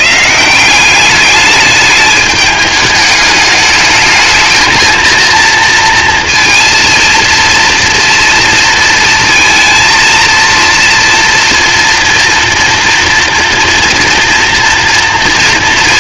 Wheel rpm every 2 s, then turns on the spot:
190, 210, 230, 230, 230, 230, 230, 230.
none